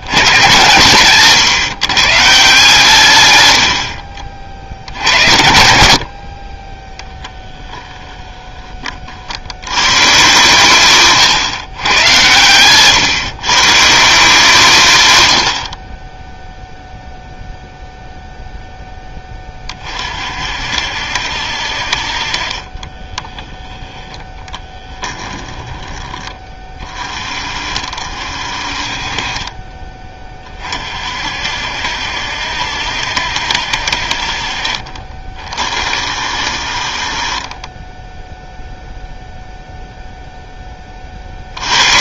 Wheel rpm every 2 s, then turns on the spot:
120, 150, 50, 20, 30, 140, 130, 160, 0, 0, 60, 30, 10, 30, 40, 40, 70, 40, 50, 0, 30.
12-14 22-26